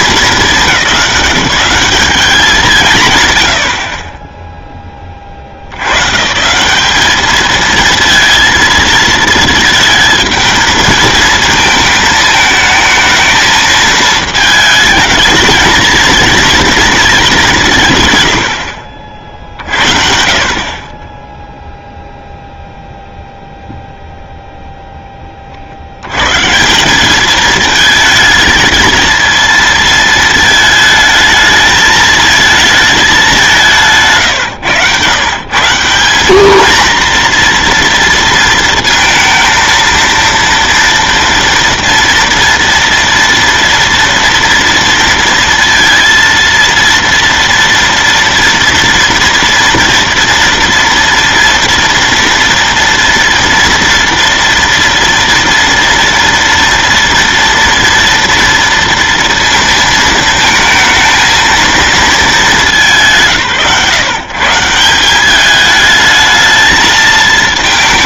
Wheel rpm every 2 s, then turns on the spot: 190, 190, 20, 180, 230, 220, 220, 220, 230, 70, 10, 0, 0, 190, 220, 220, 210, 130, 230, 230, 230, 230, 230, 230, 230, 230, 240, 230, 230, 230, 220, 160, 170, 220.
none